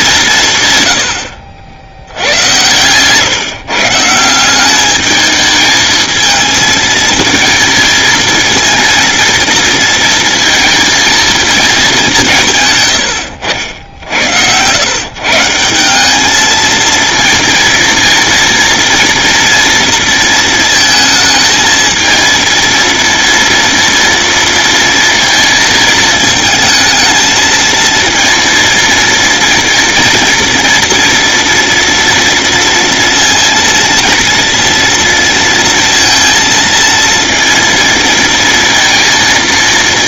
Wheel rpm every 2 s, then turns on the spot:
140, 120, 190, 220, 230, 230, 130, 110, 220, 230, 220, 230, 230, 220, 230, 230, 230, 230, 230, 230.
none